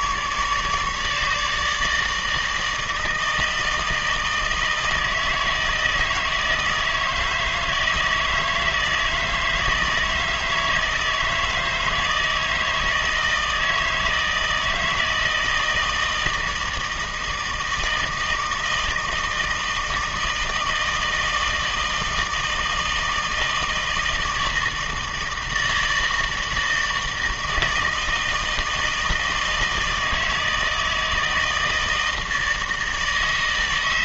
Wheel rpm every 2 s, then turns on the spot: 150, 160, 160, 160, 160, 160, 160, 160, 160, 160, 160, 160, 160, 160, 160, 160, 160.
none